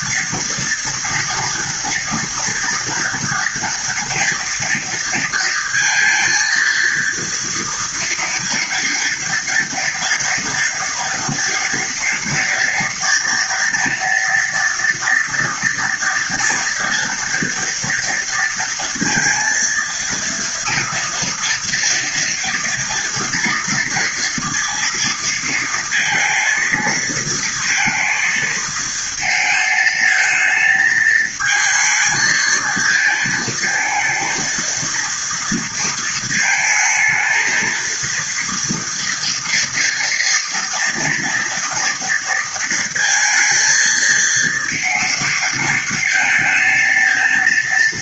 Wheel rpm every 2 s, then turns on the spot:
230, 230, 230, 230, 230, 230, 230, 230, 230, 230, 230, 230, 230, 220, 220, 220, 230, 230, 220, 230, 230, 220, 230, 230.
none